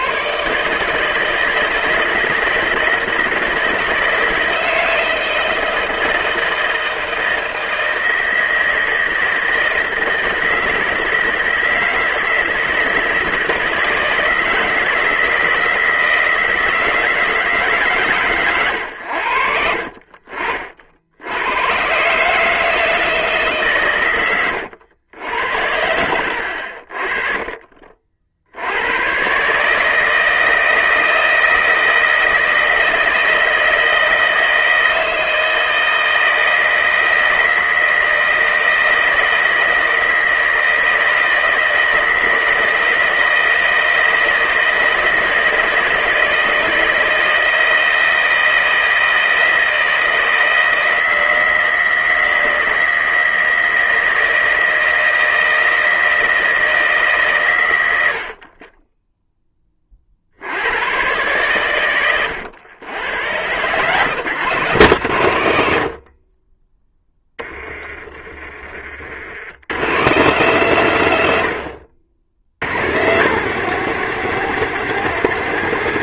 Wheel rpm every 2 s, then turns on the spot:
140, 160, 160, 160, 160, 160, 160, 160, 160, 100, 60, 160, 110, 60, 80, 160, 160, 160, 160, 160, 160, 160, 160, 160, 160, 160, 160, 160, 160, 30, 80, 100, 150, 30, 40, 140, 90, 170.
68-70